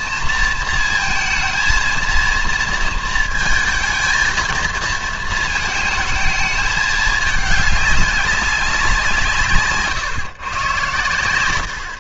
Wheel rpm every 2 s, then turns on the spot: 230, 230, 220, 220, 190, 130.
none